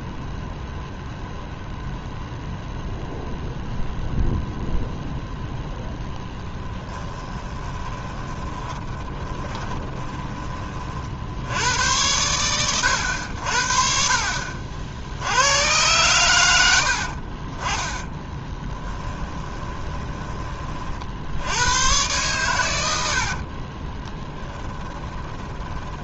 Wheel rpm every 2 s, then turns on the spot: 0, 0, 0, 10, 20, 40, 100, 60, 70, 20, 40, 90, 10.
8-10 18-20 24-26